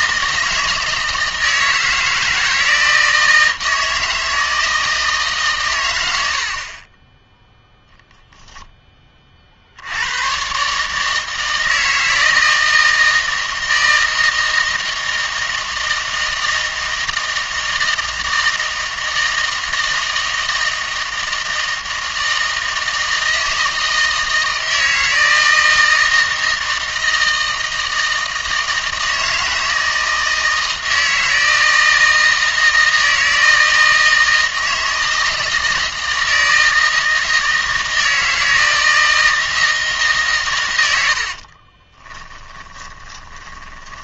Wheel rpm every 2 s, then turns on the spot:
160, 160, 160, 50, 0, 130, 160, 160, 160, 160, 160, 160, 160, 160, 160, 160, 160, 160, 160, 160, 120, 20.
42-44